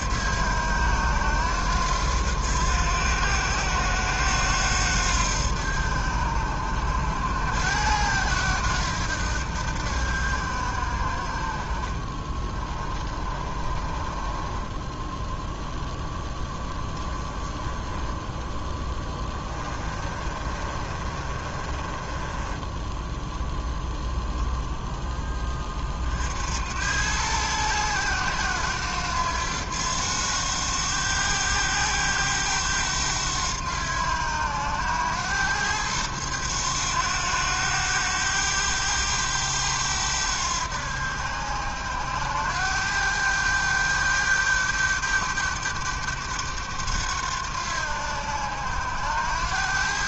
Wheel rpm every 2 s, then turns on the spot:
90, 90, 80, 80, 90, 60, 30, 10, 10, 10, 30, 10, 10, 100, 90, 100, 100, 100, 100, 100, 80, 100, 100, 90, 90.
12-14 18-24